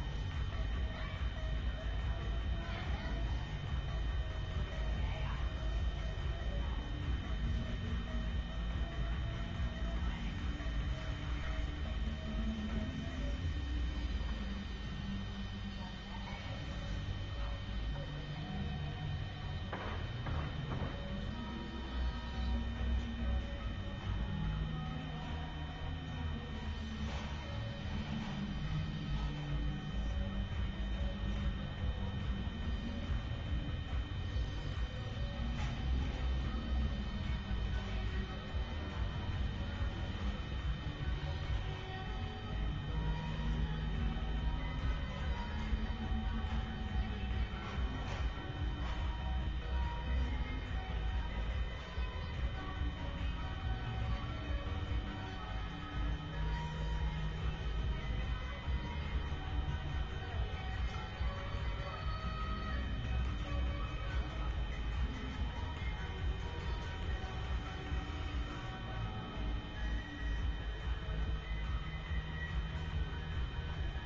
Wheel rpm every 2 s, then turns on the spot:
0, 0, 0, 0, 0, 0, 0, 0, 0, 0, 0, 0, 0, 0, 0, 0, 0, 0, 0, 0, 0, 0, 0, 0, 0, 0, 0, 0, 0, 0, 0, 0, 0, 0, 0, 0, 0.
none